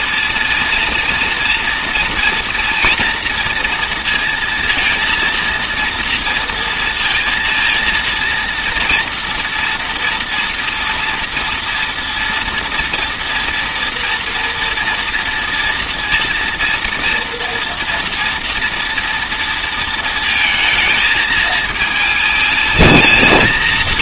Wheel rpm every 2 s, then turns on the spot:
230, 230, 230, 230, 230, 230, 230, 230, 230, 230, 220, 220.
none